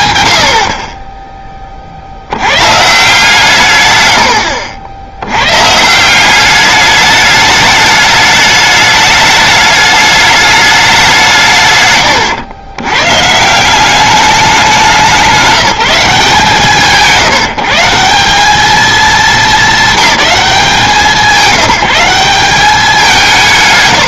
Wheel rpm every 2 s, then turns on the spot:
30, 160, 80, 210, 210, 190, 110, 190, 140, 220, 190, 200.
none